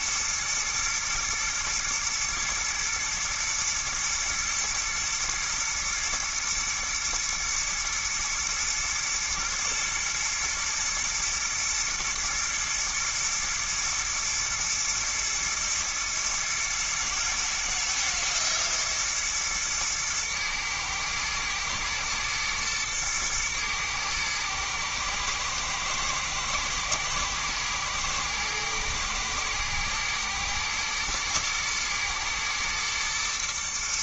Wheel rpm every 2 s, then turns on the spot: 120, 120, 110, 120, 110, 110, 110, 110, 110, 120, 110, 110, 110, 110, 120, 120, 110.
none